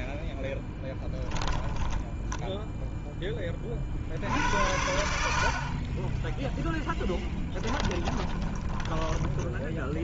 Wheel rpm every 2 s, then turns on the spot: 10, 10, 60, 0, 20.
0-4 8-10